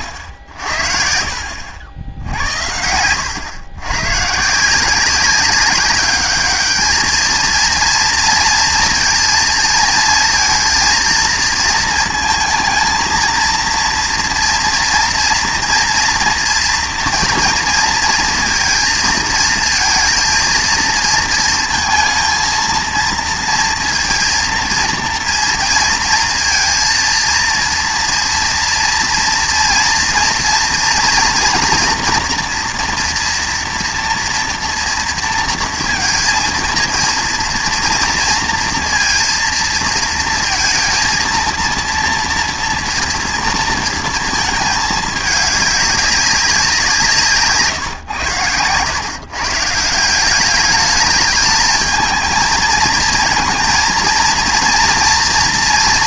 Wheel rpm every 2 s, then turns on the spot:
60, 90, 170, 210, 230, 230, 230, 240, 230, 230, 230, 230, 230, 230, 230, 230, 230, 230, 230, 230, 230, 230, 210, 180, 120, 200, 230, 230.
none